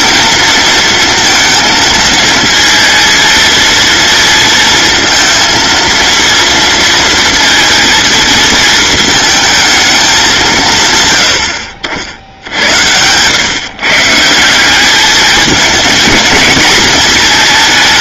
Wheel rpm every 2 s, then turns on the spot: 230, 230, 230, 230, 220, 130, 90, 190, 230.
none